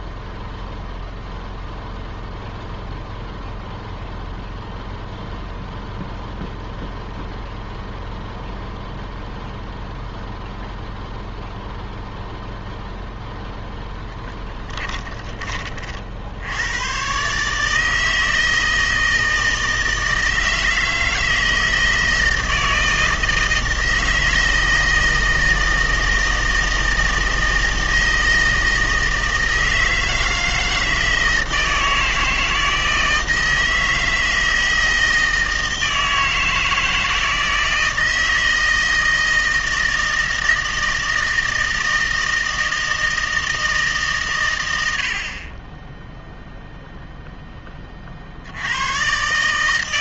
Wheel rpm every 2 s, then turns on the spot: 0, 0, 0, 0, 0, 0, 0, 10, 90, 160, 160, 160, 160, 160, 160, 160, 160, 160, 160, 160, 160, 160, 100, 0, 80.
14-16